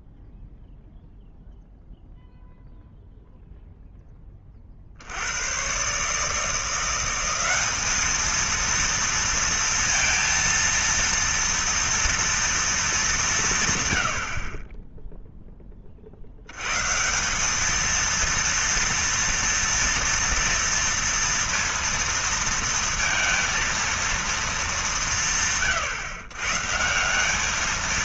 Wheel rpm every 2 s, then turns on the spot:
0, 0, 30, 160, 230, 230, 230, 40, 100, 230, 230, 230, 210, 150.
none